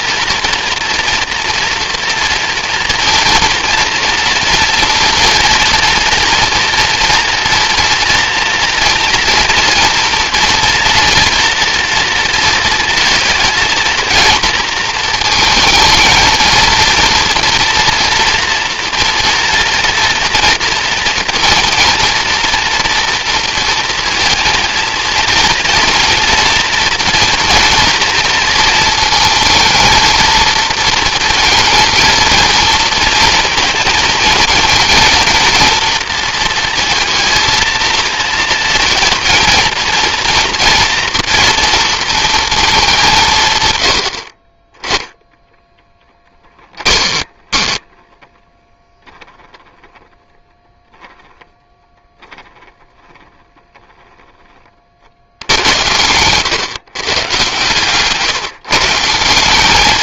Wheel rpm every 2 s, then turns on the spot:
240, 230, 230, 230, 230, 230, 230, 220, 230, 230, 230, 230, 230, 230, 230, 230, 230, 220, 230, 230, 230, 210, 20, 20, 10, 0, 10, 40, 130, 150.
46-48